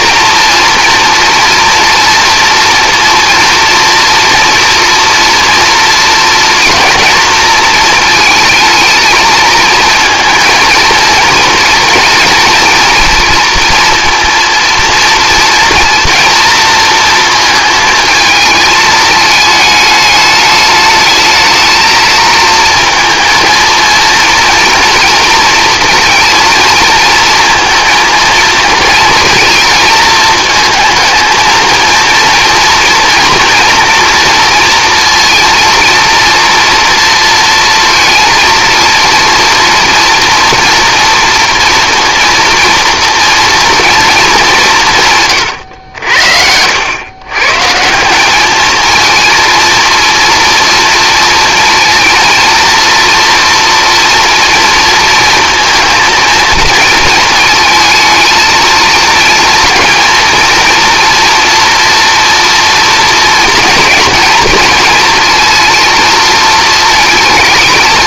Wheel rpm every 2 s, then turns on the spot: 240, 230, 230, 230, 220, 230, 220, 230, 230, 220, 220, 230, 230, 230, 220, 220, 230, 230, 230, 230, 240, 230, 170, 100, 220, 230, 230, 230, 230, 230, 230, 230, 220, 220.
none